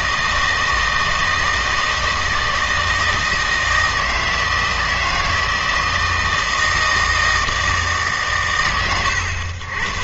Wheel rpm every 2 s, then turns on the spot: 160, 160, 160, 160, 120.
none